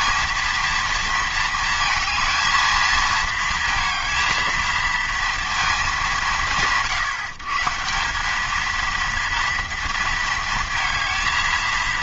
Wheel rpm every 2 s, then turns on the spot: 230, 220, 220, 160, 220, 220.
none